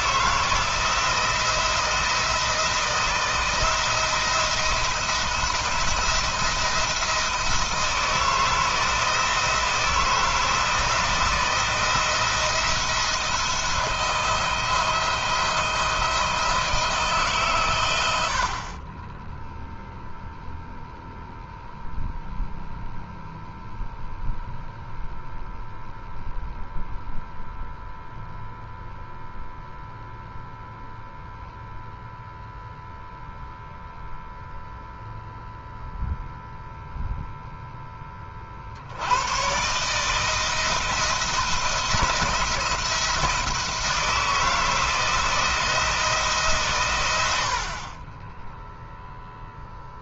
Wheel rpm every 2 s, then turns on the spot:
160, 170, 170, 170, 170, 160, 160, 170, 150, 10, 0, 0, 0, 0, 0, 0, 0, 0, 0, 90, 160, 170, 160, 100, 0.
none